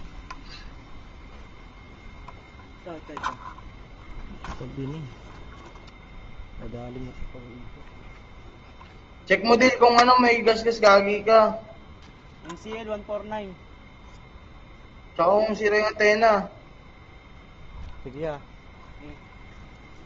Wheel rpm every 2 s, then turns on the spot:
0, 0, 0, 0, 0, 0, 0, 0, 0, 0.
none